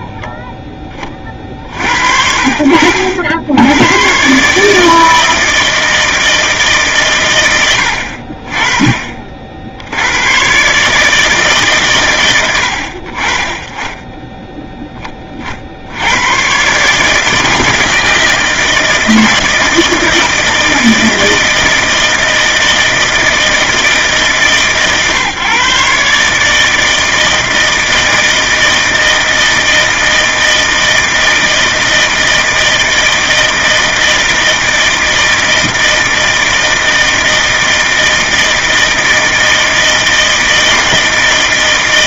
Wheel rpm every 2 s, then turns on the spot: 10, 70, 150, 160, 30, 120, 90, 10, 130, 160, 160, 160, 150, 150, 160, 160, 160, 160, 160, 160, 160.
none